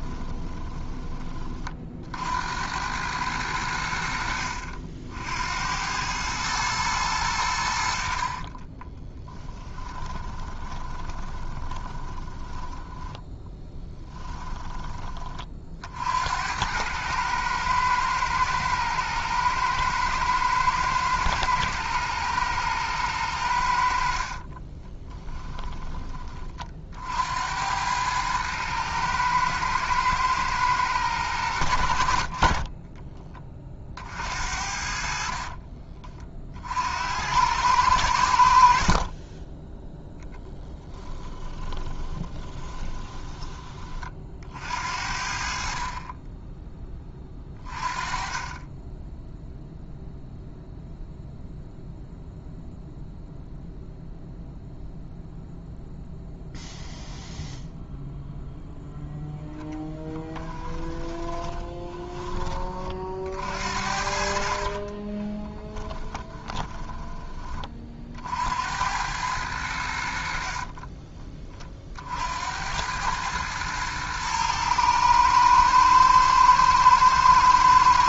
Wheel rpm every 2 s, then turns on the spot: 20, 90, 60, 110, 30, 20, 10, 20, 100, 110, 110, 110, 20, 50, 110, 100, 30, 60, 70, 50, 10, 20, 60, 20, 10, 0, 0, 0, 0, 0, 10, 40, 30, 20, 90, 40, 90, 110, 110.
0-2 8-14 24-26 32-34 40-44 60-62 64-68 70-72